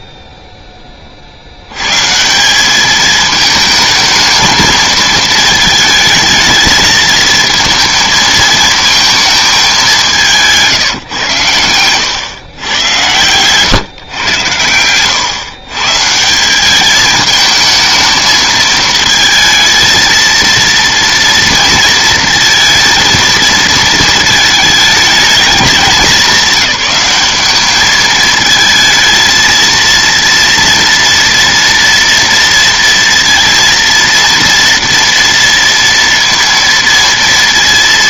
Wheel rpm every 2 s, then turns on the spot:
60, 170, 230, 220, 230, 180, 110, 100, 180, 220, 230, 230, 220, 200, 220, 230, 230, 230, 230.
none